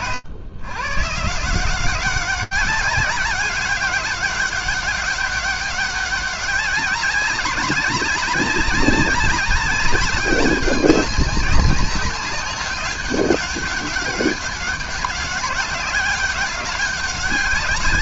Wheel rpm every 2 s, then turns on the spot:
160, 200, 200, 200, 200, 200, 200, 200, 200.
none